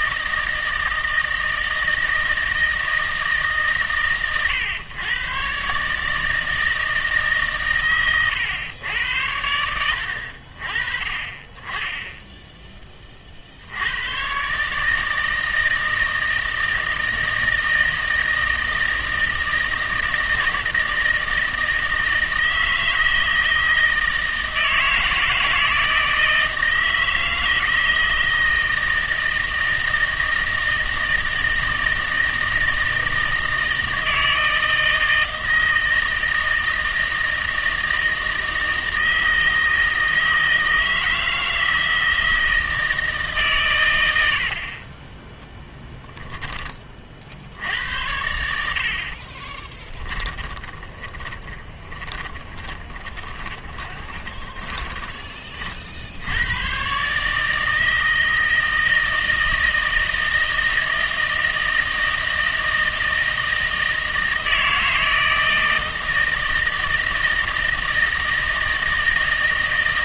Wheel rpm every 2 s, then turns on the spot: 160, 160, 120, 160, 100, 40, 10, 150, 160, 160, 160, 160, 160, 160, 160, 160, 160, 160, 160, 160, 160, 160, 40, 30, 70, 20, 20, 20, 130, 160, 160, 160, 160, 160, 160.
50-56